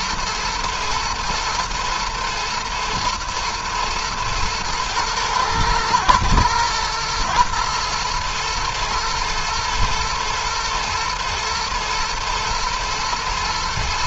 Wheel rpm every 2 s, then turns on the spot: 120, 120, 110, 120, 120, 120, 120.
none